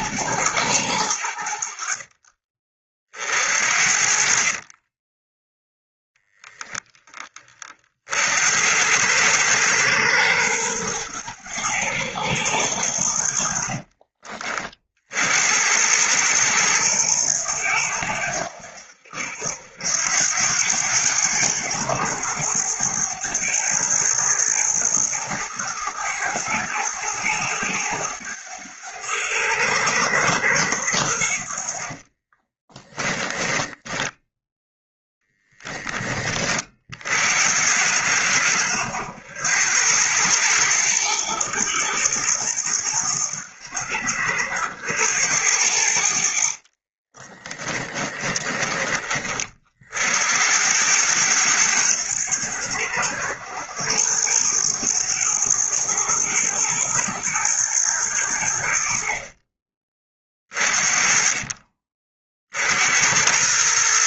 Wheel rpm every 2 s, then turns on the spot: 80, 40, 30, 10, 90, 100, 80, 50, 110, 80, 100, 100, 110, 110, 90, 80, 20, 10, 50, 70, 100, 90, 80, 30, 30, 100, 90, 100, 110, 60, 30, 70.
4-6 32-34 46-48